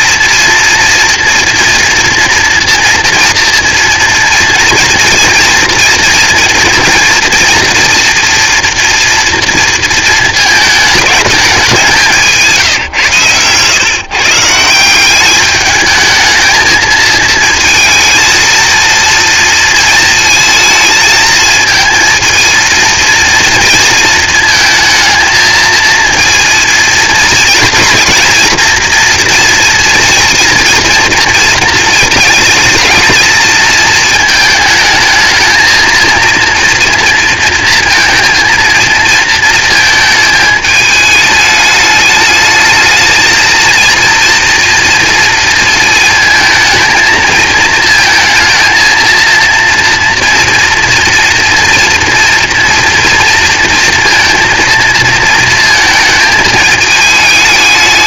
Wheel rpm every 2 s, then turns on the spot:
230, 230, 230, 230, 230, 220, 140, 180, 220, 230, 220, 230, 220, 230, 230, 230, 230, 220, 230, 230, 220, 220, 230, 220, 230, 240, 230, 230, 220.
none